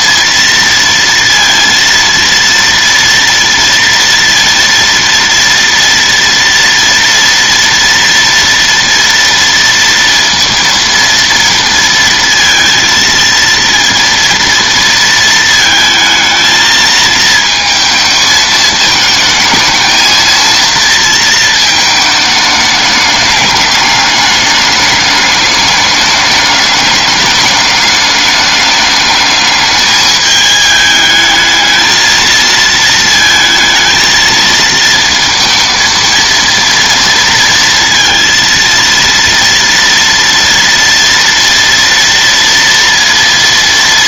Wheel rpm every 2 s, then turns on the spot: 230, 230, 230, 230, 230, 230, 230, 220, 220, 220, 230, 210, 210, 210, 210, 220, 220, 230, 230, 230, 230, 230.
none